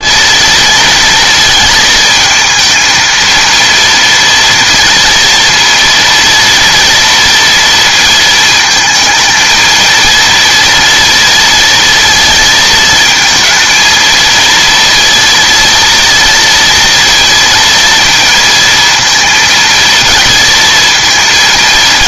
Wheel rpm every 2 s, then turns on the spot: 230, 230, 230, 230, 220, 230, 220, 230, 230, 230, 230.
none